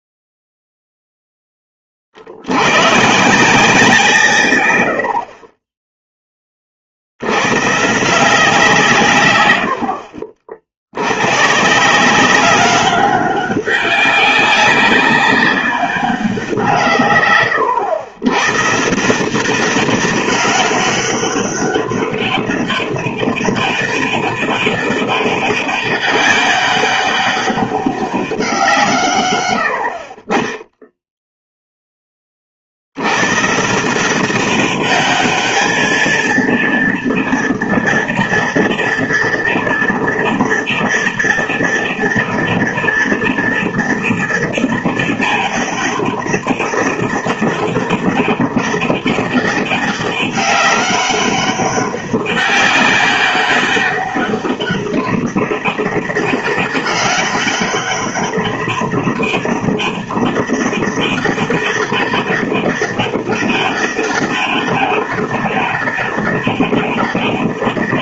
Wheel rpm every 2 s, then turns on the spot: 0, 90, 130, 20, 160, 60, 190, 200, 170, 140, 200, 200, 200, 200, 180, 10, 40, 200, 230, 230, 230, 230, 230, 200, 200, 200, 200, 200, 200, 200, 200, 200, 200, 200.
none